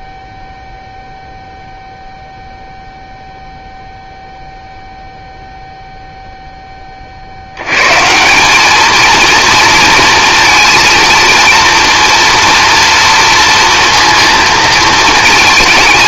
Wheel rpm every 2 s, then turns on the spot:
0, 0, 0, 20, 220, 230, 230, 230.
none